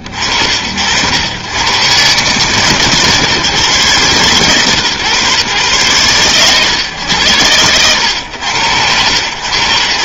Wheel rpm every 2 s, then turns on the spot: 50, 140, 130, 110, 100.
none